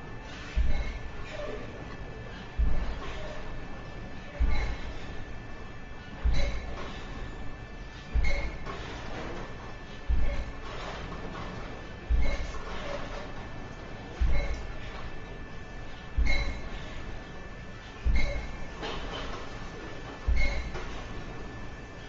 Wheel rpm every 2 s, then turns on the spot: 10, 0, 0, 0, 0, 0, 0, 0, 0, 0, 0.
none